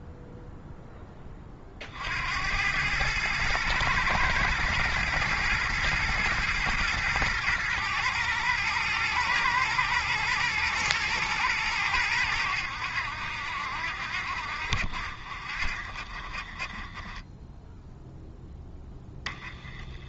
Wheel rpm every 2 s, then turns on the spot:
10, 100, 110, 110, 110, 110, 80, 60, 20, 10.
none